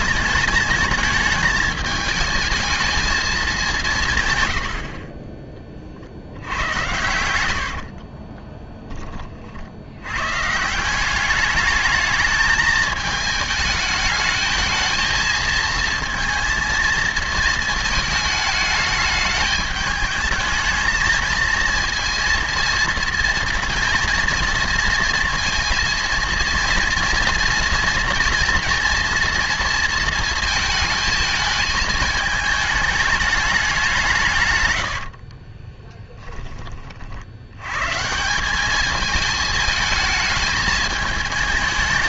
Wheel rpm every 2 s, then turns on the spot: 220, 220, 50, 90, 10, 180, 220, 220, 220, 210, 220, 230, 230, 230, 230, 220, 210, 80, 50, 210, 220.
4-8 34-36